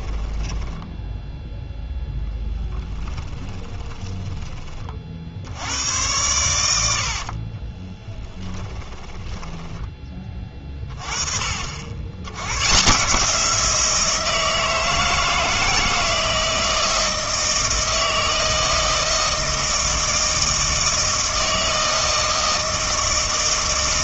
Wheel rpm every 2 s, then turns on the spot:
10, 10, 20, 90, 20, 20, 110, 160, 160, 160, 160, 160.
0-4 8-12